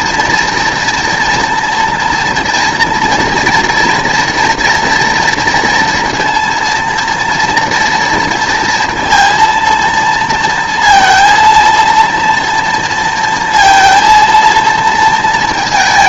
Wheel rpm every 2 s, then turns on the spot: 240, 230, 230, 230, 230, 230, 230, 230.
none